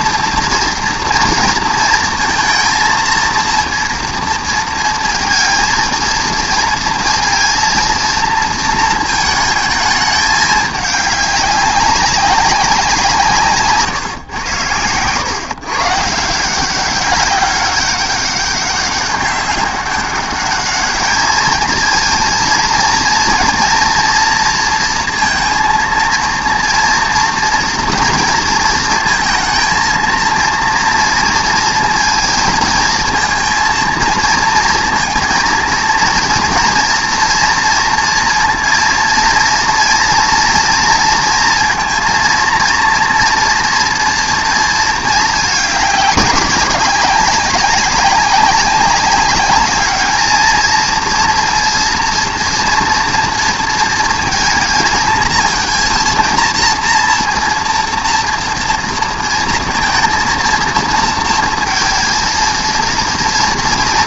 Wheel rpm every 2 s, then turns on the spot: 240, 230, 230, 230, 230, 210, 190, 110, 180, 200, 210, 230, 230, 230, 230, 230, 230, 230, 230, 230, 230, 230, 230, 200, 190, 220, 230, 230, 230, 230, 230, 230.
none